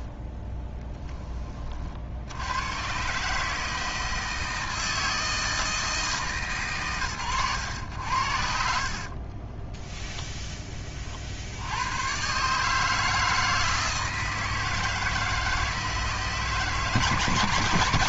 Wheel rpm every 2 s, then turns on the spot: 10, 130, 160, 120, 70, 20, 150, 160, 160.
0-2 8-10